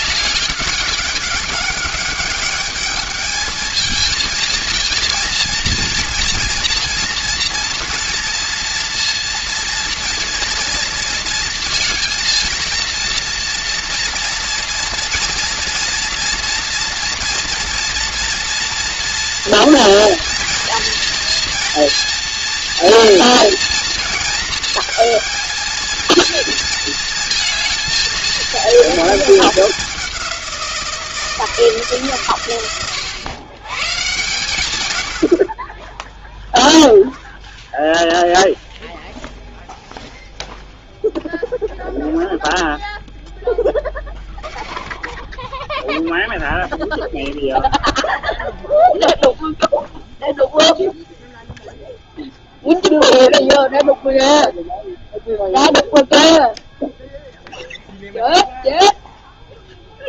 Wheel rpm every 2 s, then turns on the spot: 200, 210, 220, 230, 230, 230, 230, 230, 230, 240, 230, 230, 220, 230, 230, 180, 120, 120, 0, 0, 0, 0, 10, 0, 0, 0, 0, 0, 0, 0.
none